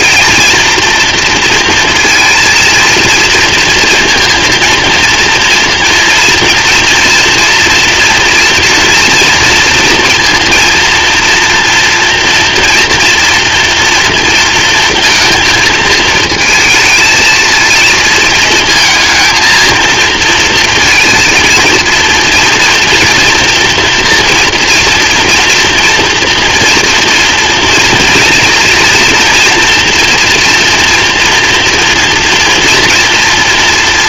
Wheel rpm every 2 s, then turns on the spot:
230, 230, 230, 230, 230, 230, 230, 230, 220, 230, 230, 230, 230, 230, 240, 240, 230.
none